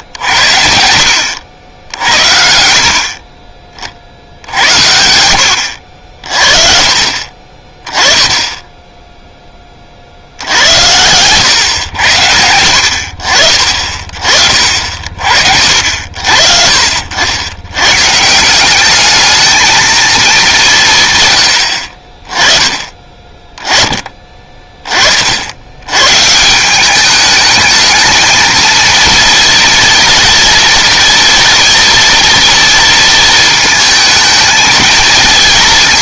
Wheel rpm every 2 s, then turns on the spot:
70, 50, 70, 50, 10, 90, 80, 50, 60, 180, 190, 20, 20, 180, 230, 230, 230, 220.
none